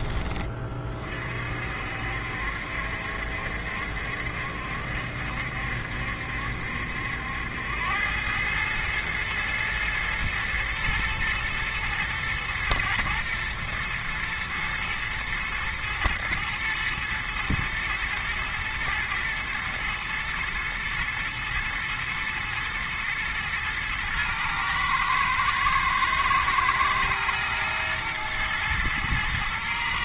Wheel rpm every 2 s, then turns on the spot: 30, 70, 70, 70, 110, 120, 120, 110, 120, 120, 110, 120, 110, 110, 110.
none